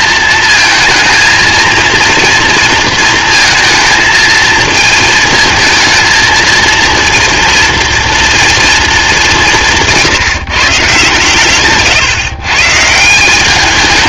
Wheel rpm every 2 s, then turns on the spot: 230, 230, 220, 230, 230, 160, 140.
none